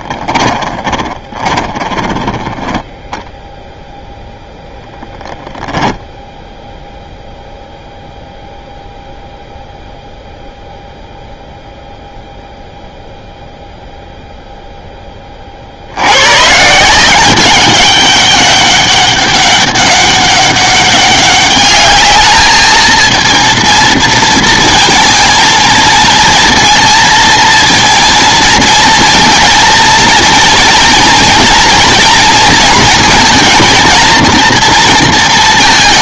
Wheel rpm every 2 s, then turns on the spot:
20, 10, 10, 0, 0, 0, 0, 10, 160, 200, 200, 220, 230, 230, 230, 240, 230, 230.
0-2 4-6